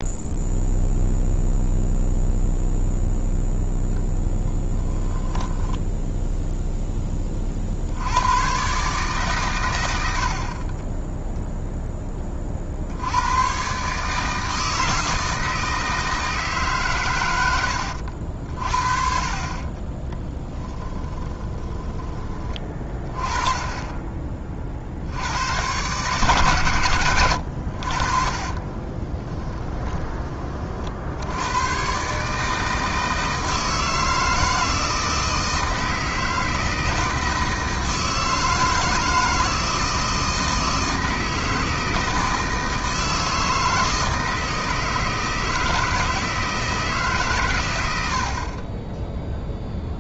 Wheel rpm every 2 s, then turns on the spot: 0, 0, 10, 10, 140, 30, 60, 160, 150, 50, 30, 30, 60, 120, 30, 50, 160, 160, 160, 160, 160, 160, 160, 160, 20.
4-6 20-22 28-30 48-50